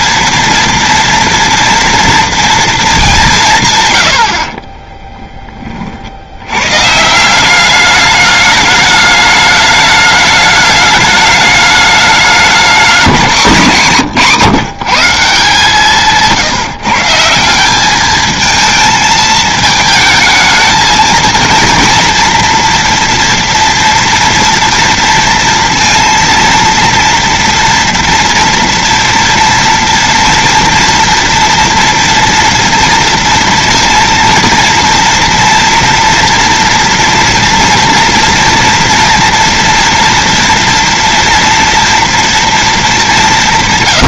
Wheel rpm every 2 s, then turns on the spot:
230, 230, 120, 50, 210, 210, 210, 160, 160, 210, 220, 240, 230, 230, 230, 230, 230, 230, 230, 240, 230, 240.
4-6